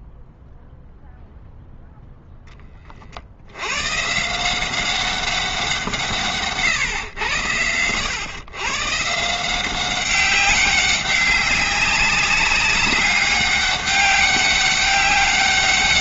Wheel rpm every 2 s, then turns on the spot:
0, 20, 180, 130, 120, 190, 200, 200.
none